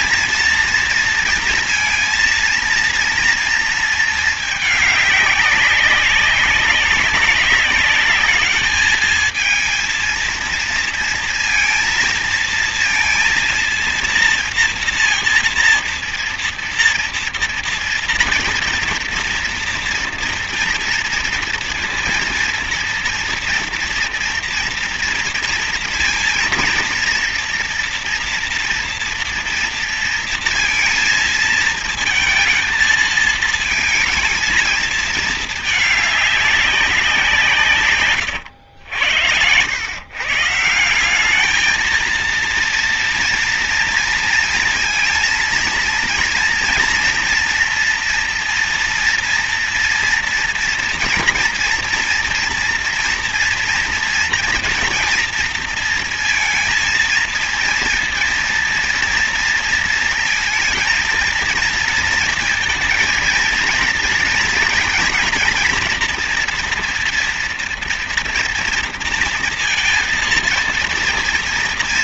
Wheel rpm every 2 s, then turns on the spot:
230, 230, 210, 190, 210, 230, 230, 230, 230, 230, 230, 230, 230, 230, 240, 230, 220, 220, 200, 100, 170, 230, 230, 240, 240, 240, 240, 230, 230, 230, 230, 230, 230, 230, 230, 230.
none